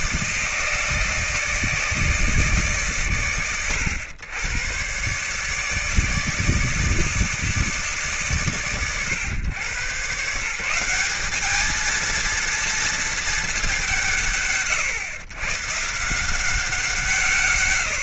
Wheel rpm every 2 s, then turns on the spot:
160, 130, 120, 160, 120, 190, 230, 120, 170.
none